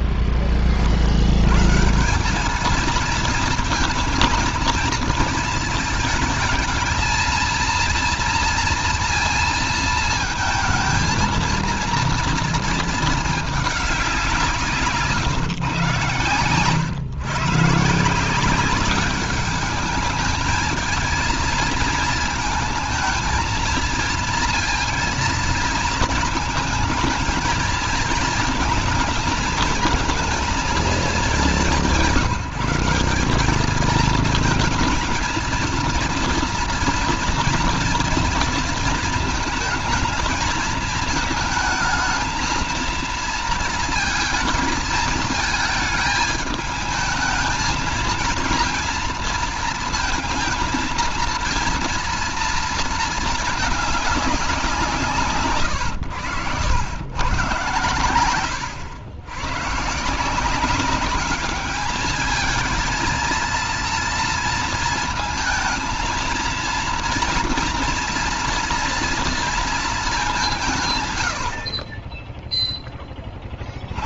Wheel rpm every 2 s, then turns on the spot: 40, 220, 220, 230, 230, 220, 220, 160, 120, 190, 220, 220, 230, 220, 220, 220, 190, 230, 230, 230, 220, 230, 220, 220, 230, 230, 230, 170, 100, 100, 190, 220, 230, 230, 230, 150, 10.
none